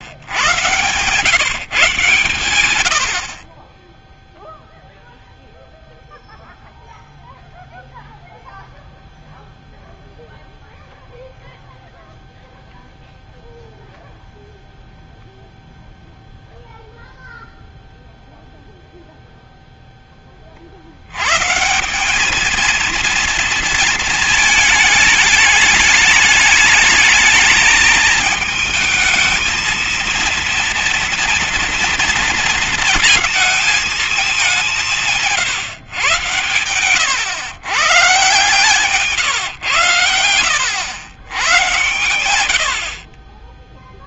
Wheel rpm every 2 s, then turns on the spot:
130, 90, 0, 0, 0, 0, 0, 0, 0, 0, 50, 220, 220, 220, 220, 230, 230, 190, 110, 140, 100, 70.
none